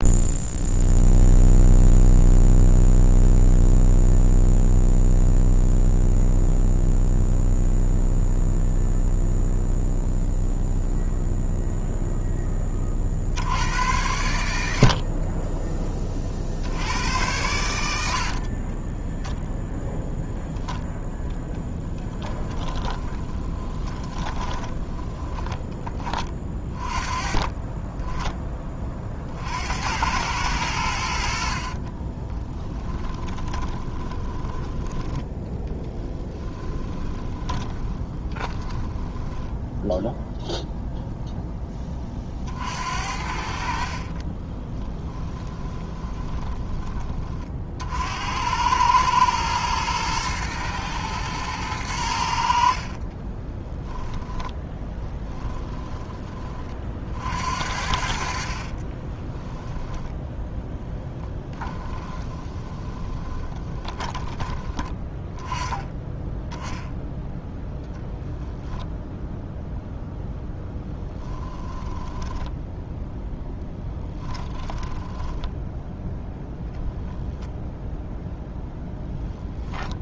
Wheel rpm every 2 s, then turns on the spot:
0, 0, 0, 0, 0, 0, 30, 50, 90, 10, 0, 20, 20, 30, 30, 80, 20, 10, 20, 20, 0, 70, 20, 20, 110, 110, 40, 10, 40, 30, 20, 20, 10, 10, 10, 0, 0, 20, 10, 0.
18-20 22-26 32-34 36-40 44-46 52-56 58-64 74-76